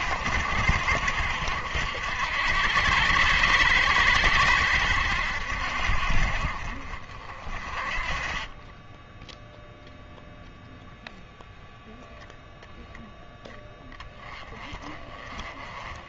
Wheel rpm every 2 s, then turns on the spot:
70, 80, 80, 40, 10, 0, 0, 20.
none